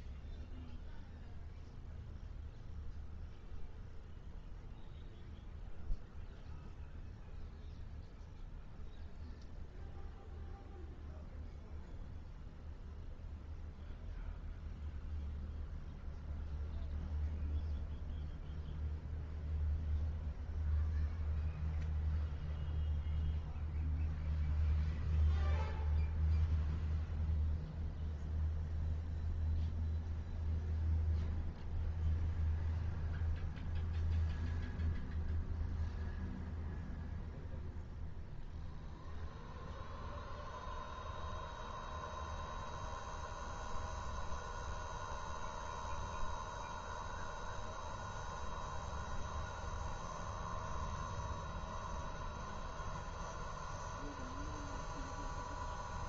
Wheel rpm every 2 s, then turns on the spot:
0, 0, 0, 0, 0, 0, 0, 0, 0, 0, 0, 0, 0, 0, 0, 0, 0, 0, 0, 0, 0, 0, 0, 0, 0, 0, 0, 0.
none